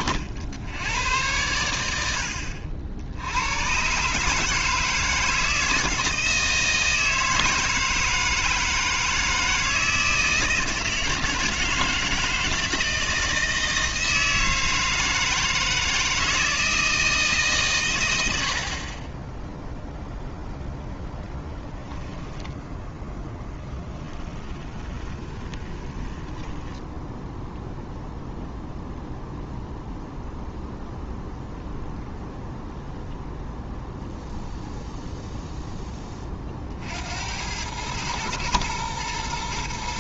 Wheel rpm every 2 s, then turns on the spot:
110, 80, 140, 170, 160, 160, 160, 160, 160, 80, 0, 10, 20, 0, 0, 0, 0, 0, 70, 120.
24-26